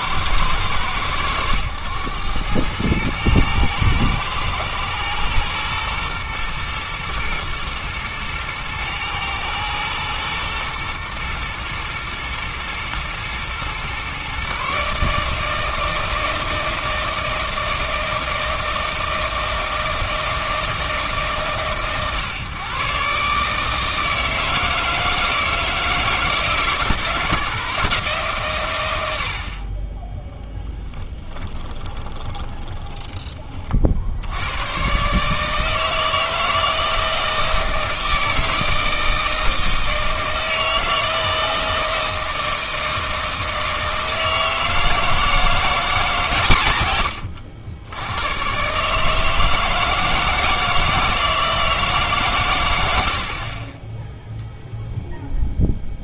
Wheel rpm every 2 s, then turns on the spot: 110, 110, 110, 110, 110, 120, 110, 140, 160, 160, 160, 130, 160, 160, 120, 20, 10, 100, 160, 160, 160, 160, 160, 130, 130, 160, 120, 0.
30-34